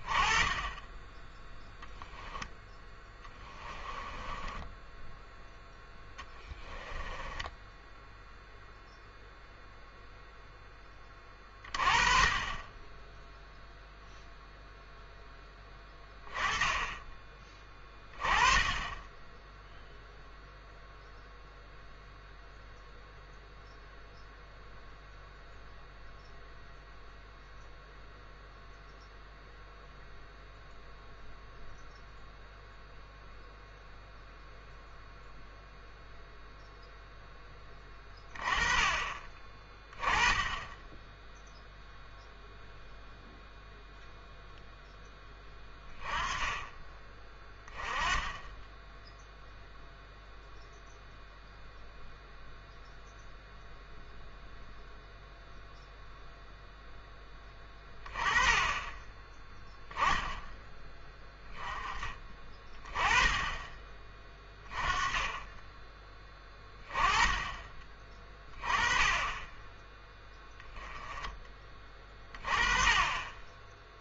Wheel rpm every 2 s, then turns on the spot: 10, 10, 10, 20, 0, 10, 20, 0, 20, 20, 0, 0, 0, 0, 0, 0, 0, 0, 0, 30, 10, 0, 0, 20, 10, 0, 0, 0, 0, 20, 10, 20, 20, 20, 20, 10, 20.
2-8